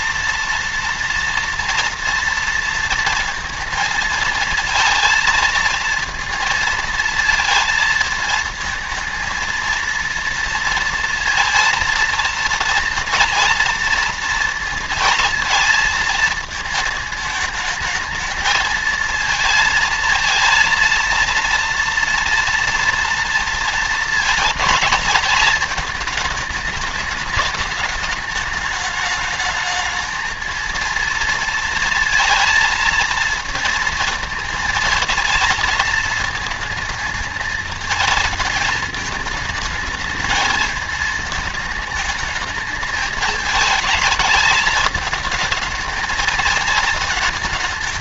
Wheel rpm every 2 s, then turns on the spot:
230, 230, 230, 230, 230, 230, 230, 230, 220, 220, 230, 240, 220, 210, 210, 230, 230, 230, 220, 220, 220, 210, 210, 220.
none